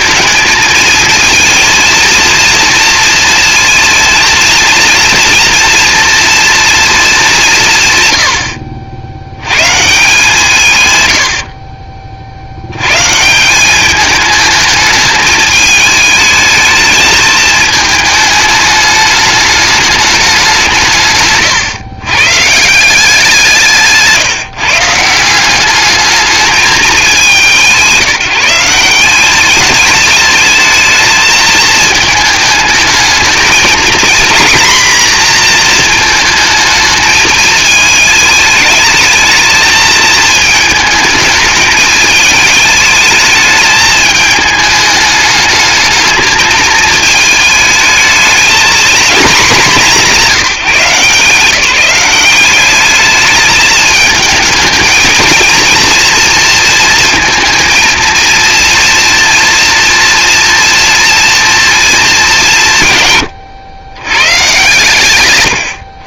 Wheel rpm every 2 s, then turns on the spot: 220, 230, 230, 230, 70, 170, 120, 220, 220, 210, 170, 180, 160, 200, 170, 220, 220, 230, 220, 220, 220, 210, 210, 220, 230, 170, 210, 220, 230, 230, 230, 150, 130.
none